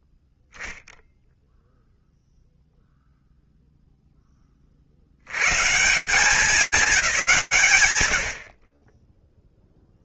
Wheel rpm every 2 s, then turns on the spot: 0, 0, 80, 190, 0.
none